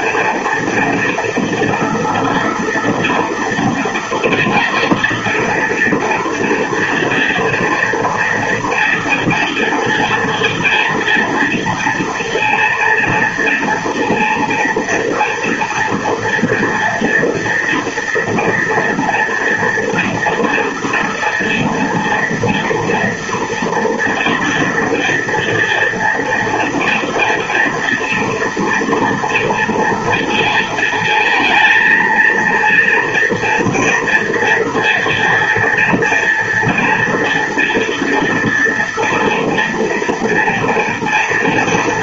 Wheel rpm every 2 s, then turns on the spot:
230, 230, 230, 230, 230, 230, 230, 230, 230, 230, 240, 240, 240, 230, 240, 230, 230, 230, 230, 230, 230.
none